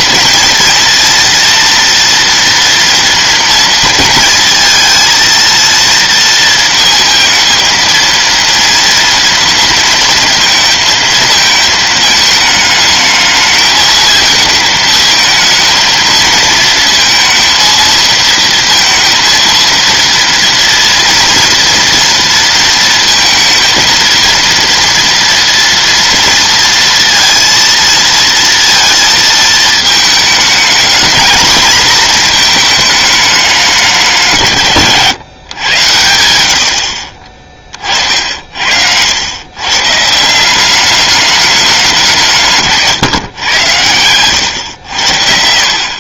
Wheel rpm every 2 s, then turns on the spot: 230, 230, 220, 230, 230, 230, 220, 220, 230, 230, 230, 230, 230, 230, 230, 220, 220, 150, 70, 80, 190, 150, 100.
none